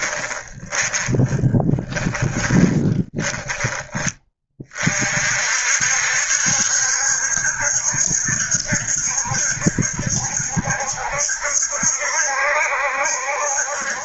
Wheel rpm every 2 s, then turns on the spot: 20, 10, 40, 70, 70, 70, 70.
0-4